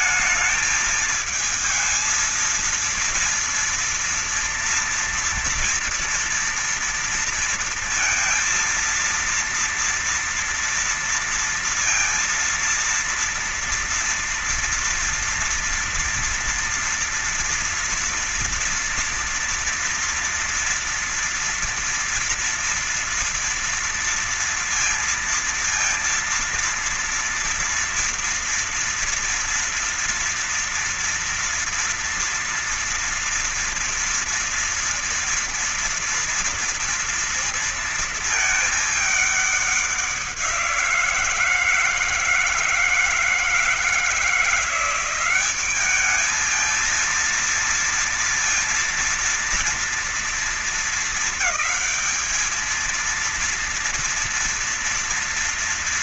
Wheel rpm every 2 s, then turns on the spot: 220, 230, 230, 230, 230, 230, 230, 230, 230, 230, 230, 230, 230, 230, 240, 240, 230, 230, 230, 220, 190, 160, 170, 210, 230, 230, 220, 230.
none